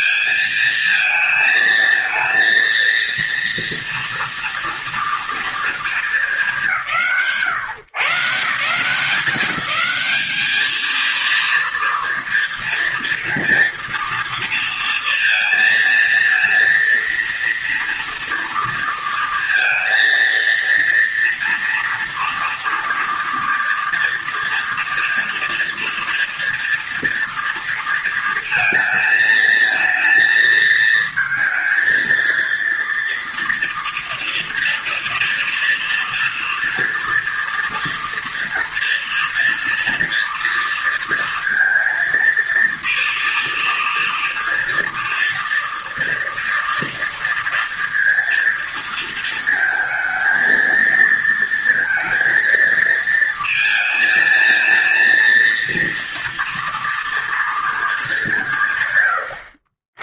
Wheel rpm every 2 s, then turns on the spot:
220, 230, 240, 160, 170, 230, 230, 230, 230, 230, 230, 240, 240, 230, 230, 230, 230, 230, 230, 230, 230, 230, 230, 230, 230, 230, 230, 230, 230, 130.
none